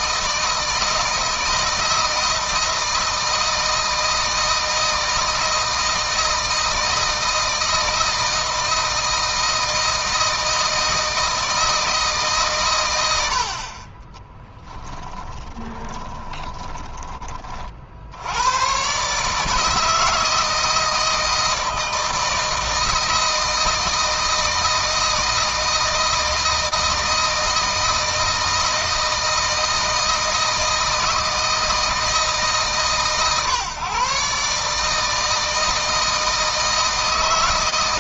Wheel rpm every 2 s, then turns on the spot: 160, 160, 160, 160, 160, 160, 110, 10, 20, 130, 160, 160, 160, 160, 160, 160, 150, 150, 160.
14-16